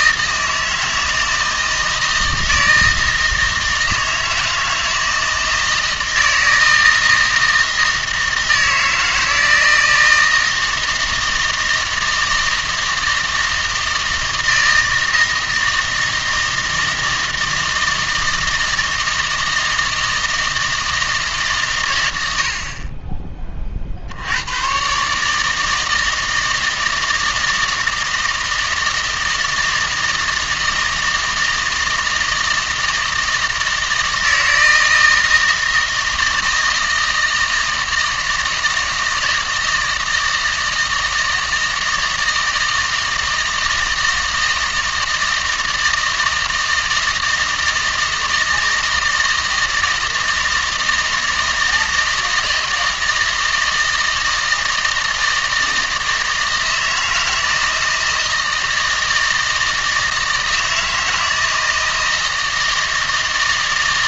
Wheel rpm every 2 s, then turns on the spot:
160, 160, 160, 160, 160, 160, 160, 160, 160, 160, 160, 40, 120, 160, 160, 160, 160, 160, 160, 160, 160, 160, 160, 160, 160, 160, 160, 160, 160, 160, 160, 160.
none